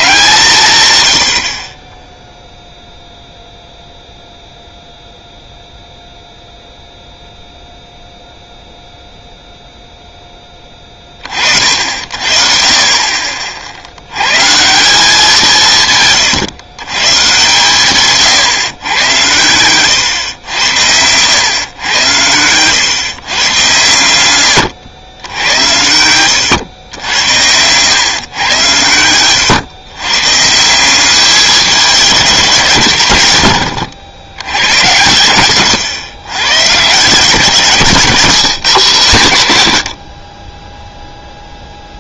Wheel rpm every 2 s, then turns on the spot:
160, 0, 0, 0, 0, 10, 50, 150, 140, 130, 100, 110, 100, 110, 110, 150, 170, 110, 110, 150, 30.
none